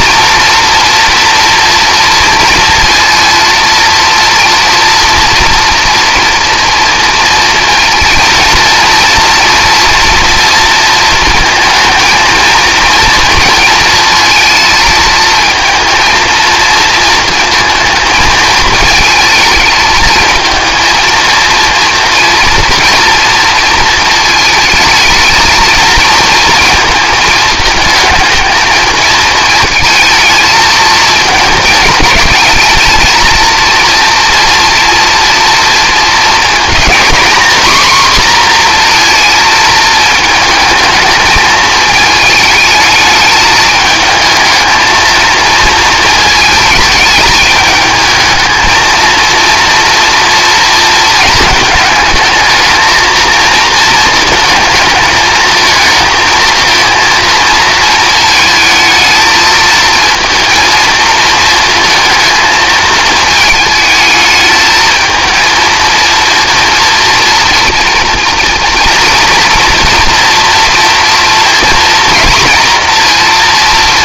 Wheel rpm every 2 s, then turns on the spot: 240, 230, 230, 230, 230, 230, 230, 230, 230, 220, 230, 230, 220, 230, 220, 220, 220, 230, 230, 240, 220, 220, 220, 220, 220, 230, 220, 230, 230, 220, 230, 220, 220, 230, 230, 230, 230.
none